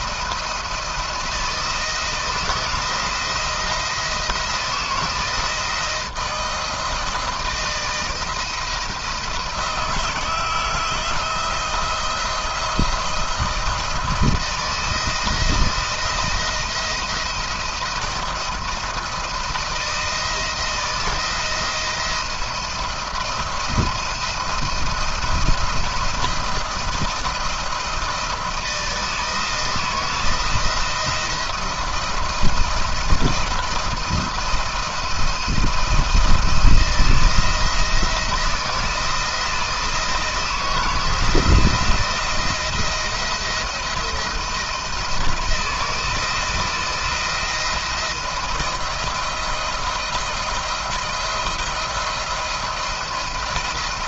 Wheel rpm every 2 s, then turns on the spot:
170, 170, 160, 160, 160, 160, 170, 170, 170, 170, 160, 160, 170, 170, 160, 170, 170, 170, 160, 160, 160, 170, 170, 160, 170, 170, 170.
none